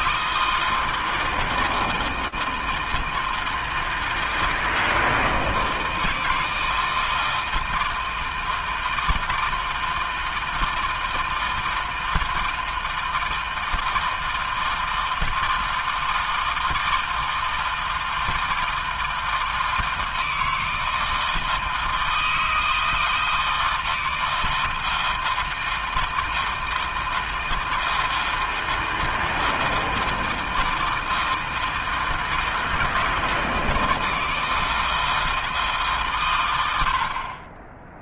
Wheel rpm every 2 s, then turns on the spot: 160, 160, 160, 160, 160, 160, 160, 160, 160, 160, 160, 160, 160, 170, 160, 160, 160, 160, 120.
none